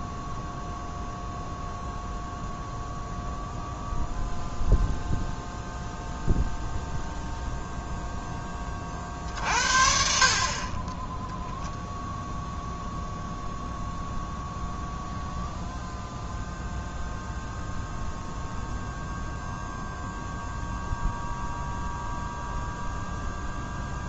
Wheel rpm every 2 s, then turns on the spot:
0, 0, 0, 0, 30, 30, 0, 0, 0, 0, 0, 0.
none